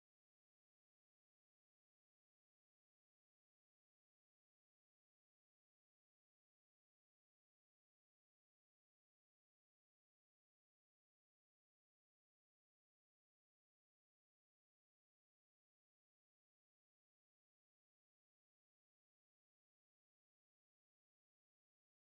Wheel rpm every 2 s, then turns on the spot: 10, 10, 0, 60, 70, 40, 0, 0, 70, 10, 0.
0-4 18-20